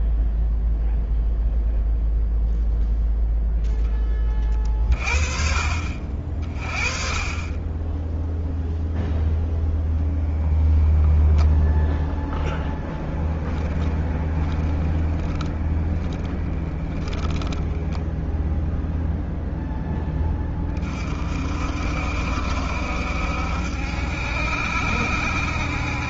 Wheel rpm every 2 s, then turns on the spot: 0, 0, 30, 50, 0, 10, 0, 20, 10, 0, 20, 70, 70.
14-16